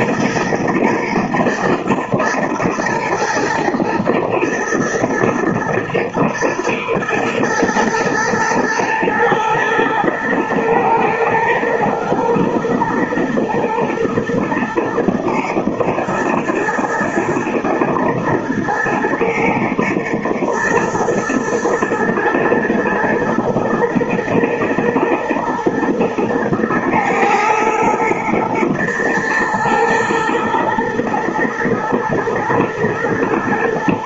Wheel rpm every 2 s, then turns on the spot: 120, 120, 120, 110, 110, 110, 120, 120, 110, 120, 110, 120, 120, 110, 110, 110, 110.
none